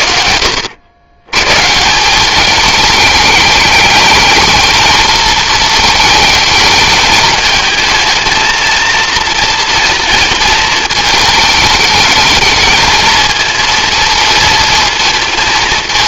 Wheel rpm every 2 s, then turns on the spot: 60, 210, 220, 220, 230, 220, 220, 220.
none